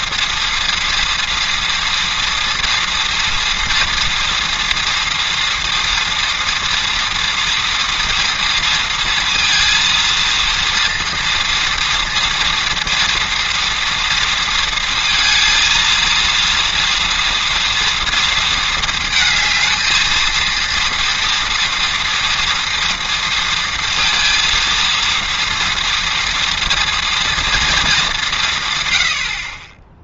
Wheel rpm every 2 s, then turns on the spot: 230, 230, 230, 230, 230, 230, 230, 230, 230, 220, 230, 230, 230, 230, 110.
none